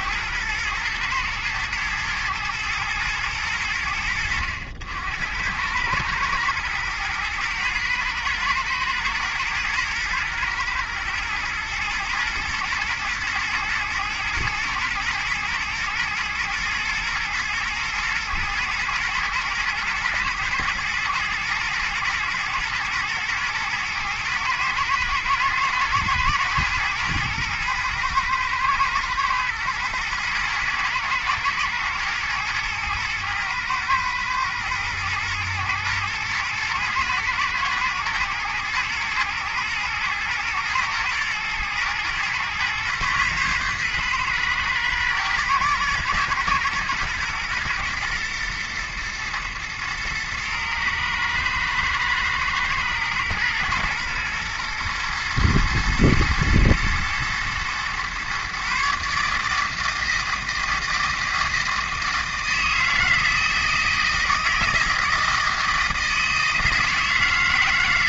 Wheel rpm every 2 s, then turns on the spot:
110, 110, 90, 110, 110, 120, 120, 120, 120, 110, 110, 110, 110, 120, 120, 110, 110, 110, 110, 110, 110, 120, 120, 120, 120, 110, 110, 120, 120, 140, 160, 160, 160, 160.
none